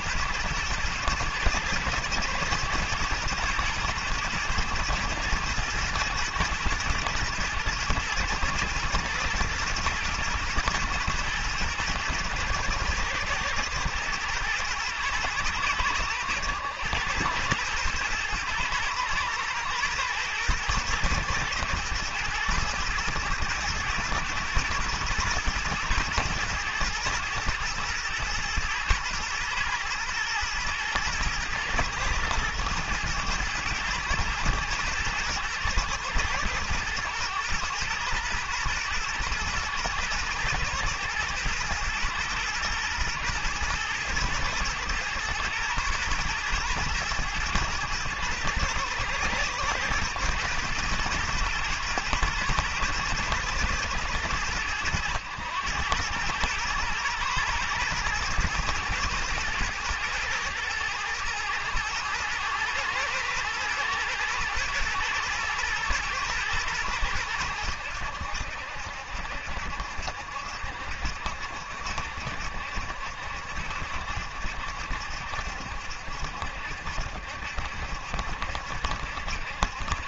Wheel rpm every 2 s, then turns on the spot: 110, 110, 110, 110, 110, 110, 110, 110, 110, 110, 120, 110, 110, 120, 120, 110, 110, 110, 110, 120, 120, 110, 110, 120, 110, 120, 120, 100, 110, 110, 110, 120, 120, 100, 70, 60, 70, 70, 60, 60.
none